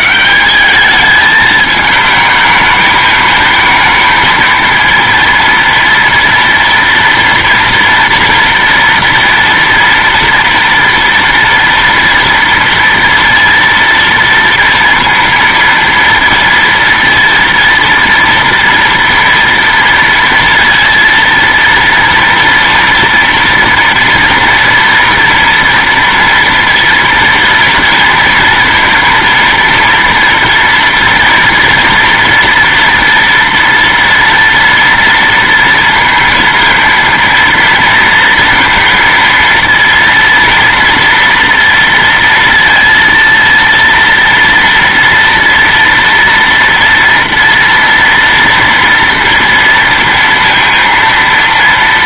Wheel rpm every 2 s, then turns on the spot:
160, 210, 220, 230, 230, 240, 230, 230, 230, 230, 230, 230, 230, 230, 230, 230, 230, 240, 230, 230, 240, 230, 230, 230, 230, 230.
none